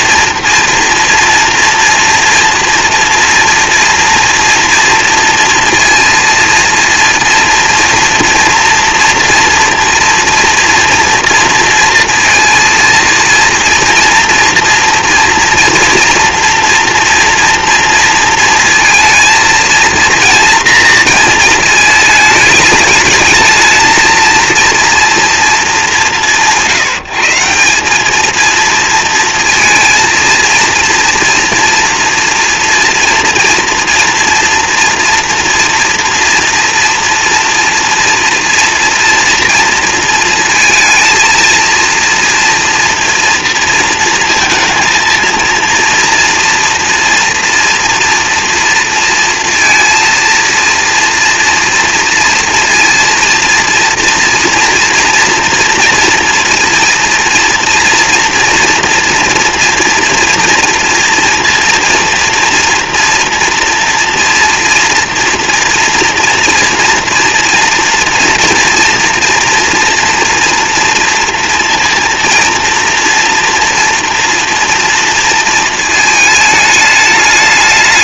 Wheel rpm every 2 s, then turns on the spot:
240, 230, 230, 230, 240, 240, 230, 240, 230, 220, 230, 220, 230, 160, 230, 230, 230, 230, 230, 230, 220, 230, 230, 240, 230, 230, 230, 240, 230, 230, 230, 230, 230, 230, 230, 230, 230, 230, 210.
none